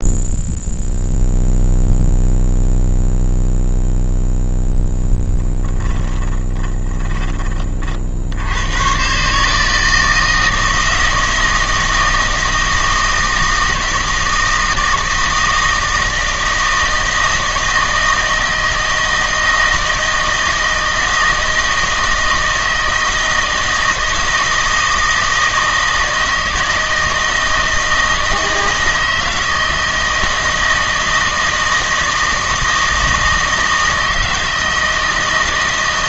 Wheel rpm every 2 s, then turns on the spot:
0, 0, 10, 20, 120, 160, 160, 160, 160, 160, 160, 160, 160, 160, 160, 160, 160, 160.
4-8